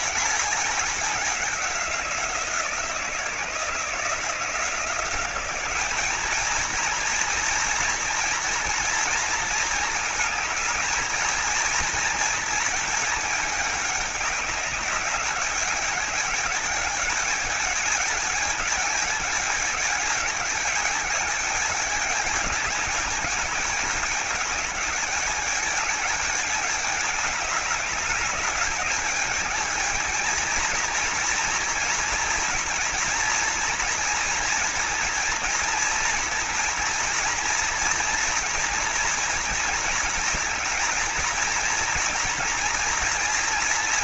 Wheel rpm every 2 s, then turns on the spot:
210, 170, 170, 220, 230, 220, 220, 200, 210, 210, 210, 220, 210, 210, 210, 230, 230, 230, 230, 240, 220, 230.
none